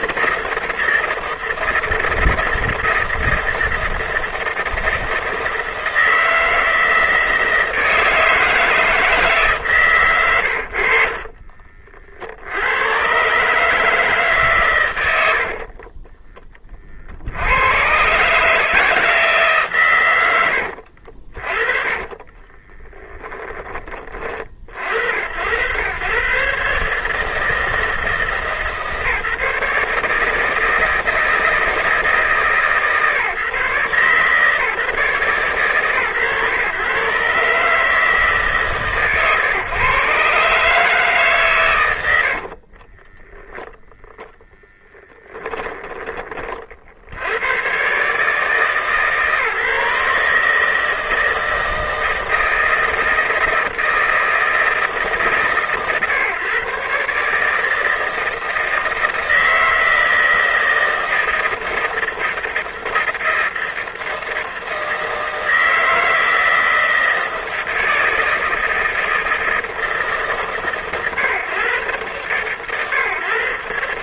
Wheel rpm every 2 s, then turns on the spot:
160, 160, 160, 160, 160, 70, 90, 100, 30, 160, 70, 10, 50, 150, 150, 160, 150, 140, 130, 140, 150, 30, 10, 50, 150, 160, 160, 160, 140, 160, 160, 160, 160, 160, 160, 130, 130.
20-24 42-44